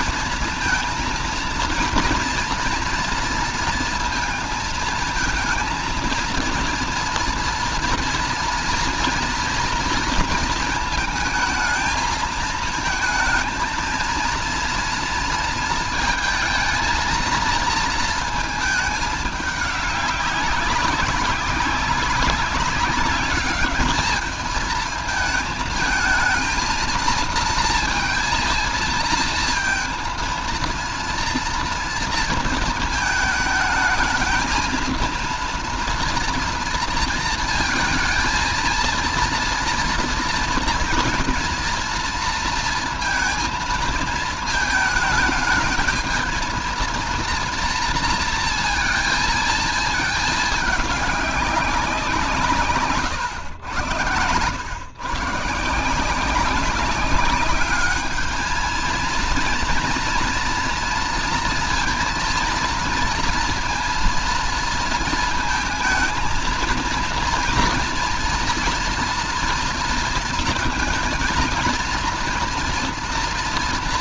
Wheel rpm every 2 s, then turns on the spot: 230, 230, 220, 230, 230, 230, 220, 230, 220, 220, 200, 190, 220, 230, 230, 230, 230, 230, 230, 230, 230, 230, 220, 230, 230, 210, 160, 110, 190, 220, 230, 230, 230, 230, 230, 230, 230.
52-54